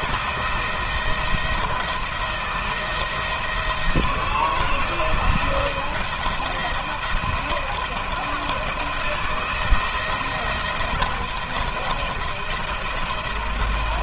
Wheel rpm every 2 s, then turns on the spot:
170, 170, 170, 170, 170, 170, 170.
none